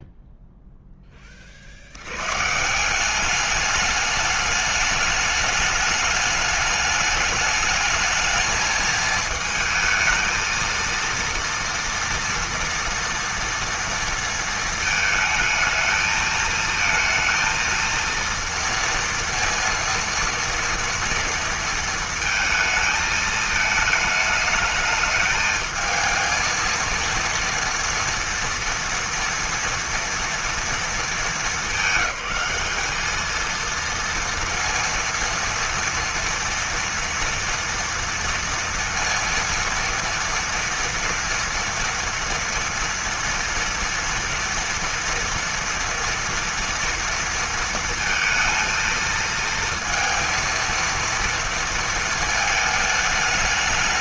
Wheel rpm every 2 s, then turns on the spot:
0, 150, 210, 210, 220, 230, 230, 230, 220, 230, 230, 220, 210, 230, 230, 230, 210, 230, 230, 230, 230, 230, 230, 240, 230, 230, 220.
none